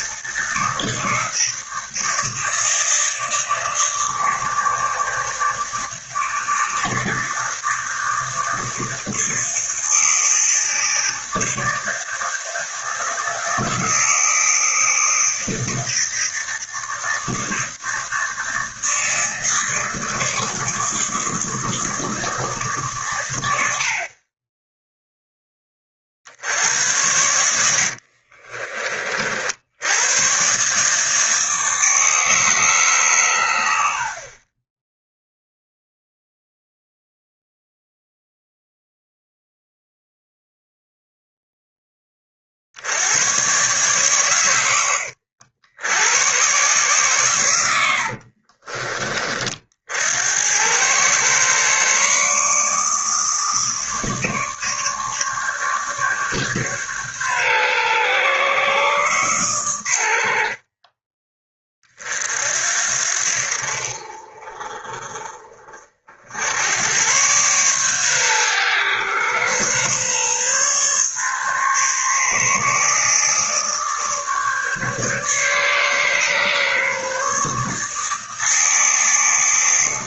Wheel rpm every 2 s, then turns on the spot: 160, 160, 150, 160, 160, 160, 160, 160, 160, 160, 160, 140, 10, 80, 40, 140, 140, 10, 0, 0, 0, 70, 100, 130, 40, 110, 150, 150, 140, 140, 30, 60, 40, 90, 110, 140, 150, 150, 140, 160.
48-50